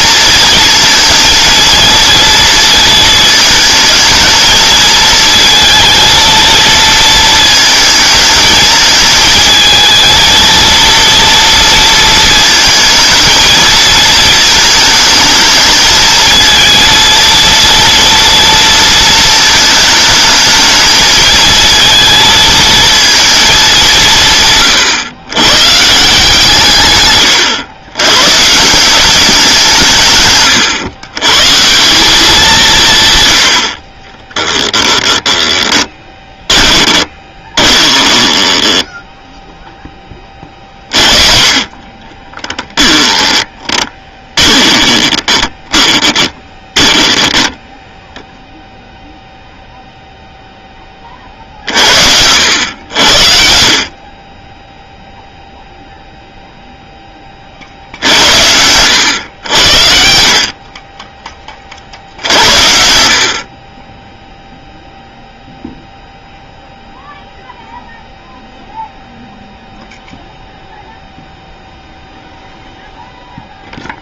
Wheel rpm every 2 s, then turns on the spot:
220, 230, 220, 230, 220, 230, 220, 220, 230, 230, 220, 230, 140, 130, 180, 120, 150, 10, 20, 10, 40, 10, 20, 20, 0, 20, 90, 0, 10, 90, 30, 70, 0, 0, 0, 0, 0.
34-40 42-48